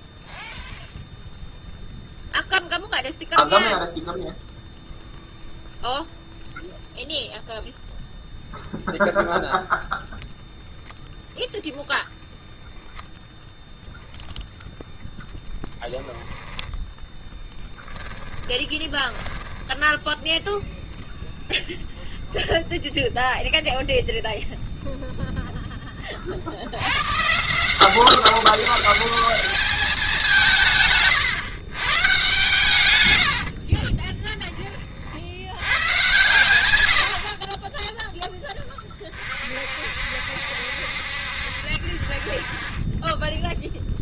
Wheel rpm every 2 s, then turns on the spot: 0, 0, 0, 0, 0, 0, 0, 0, 10, 10, 0, 0, 0, 100, 200, 150, 110, 40, 100, 30, 60, 20.
18-20